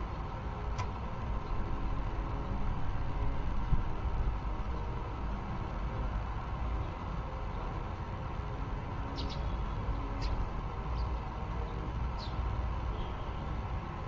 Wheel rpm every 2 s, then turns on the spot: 0, 0, 0, 0, 0, 0, 0.
none